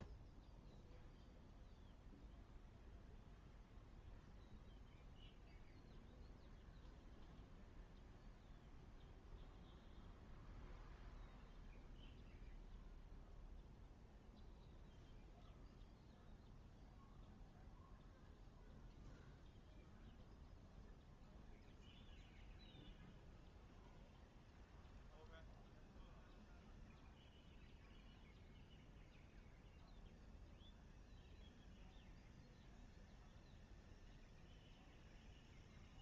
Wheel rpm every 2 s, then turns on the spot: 0, 0, 0, 0, 0, 0, 0, 0, 0, 0, 0, 0, 0, 0, 0, 0, 0, 0.
none